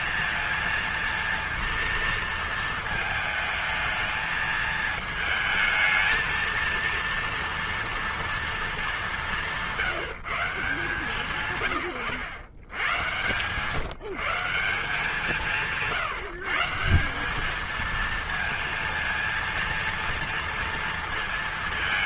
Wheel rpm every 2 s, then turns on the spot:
230, 220, 220, 230, 220, 160, 100, 180, 160, 230, 230.
none